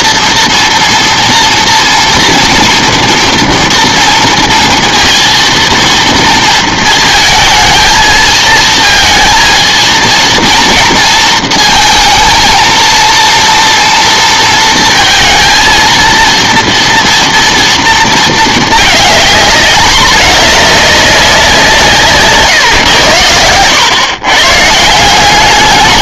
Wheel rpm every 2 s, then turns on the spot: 230, 240, 230, 220, 220, 230, 230, 230, 230, 220, 210, 120, 150.
none